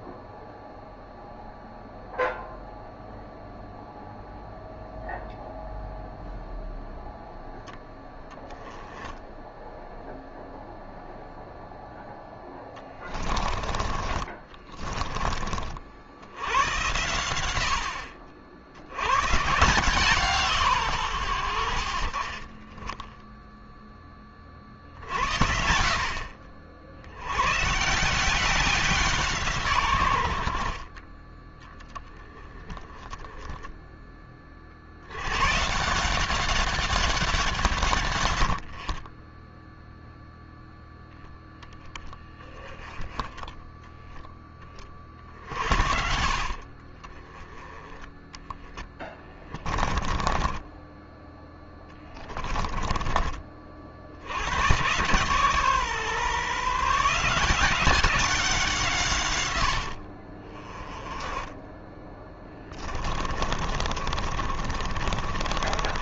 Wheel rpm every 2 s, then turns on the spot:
0, 0, 0, 0, 10, 0, 10, 20, 100, 90, 130, 20, 50, 80, 180, 30, 10, 60, 200, 50, 0, 10, 40, 40, 10, 20, 20, 120, 160, 170, 20, 10, 40.
12-16 22-24 48-52 62-66